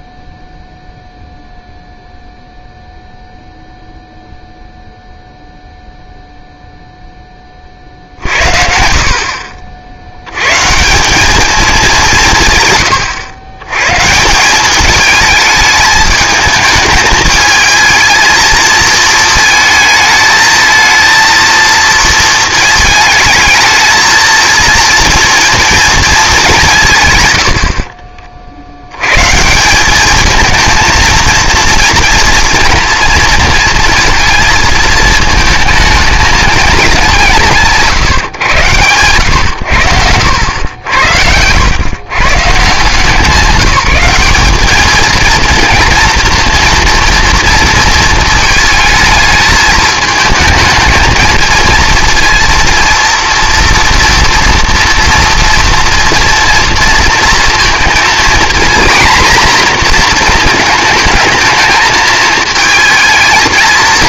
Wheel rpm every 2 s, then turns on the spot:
0, 0, 0, 50, 60, 200, 130, 220, 220, 220, 230, 230, 220, 40, 190, 230, 230, 220, 120, 90, 100, 190, 230, 230, 220, 230, 230, 230, 230, 240, 220, 220.
26-28